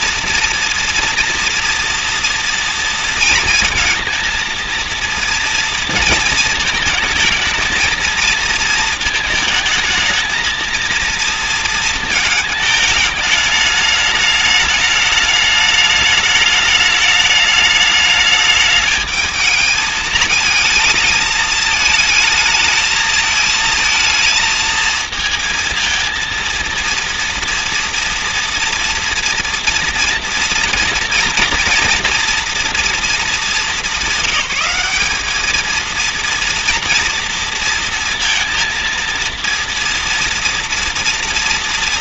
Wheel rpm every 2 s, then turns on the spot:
230, 230, 230, 220, 230, 230, 220, 210, 210, 210, 220, 220, 230, 230, 240, 230, 230, 200, 230, 230, 230.
none